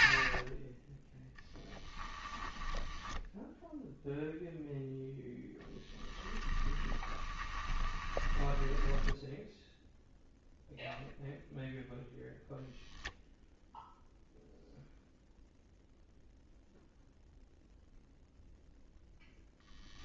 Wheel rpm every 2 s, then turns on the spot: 20, 10, 0, 20, 10, 0, 0, 0, 0, 0.
2-4 6-10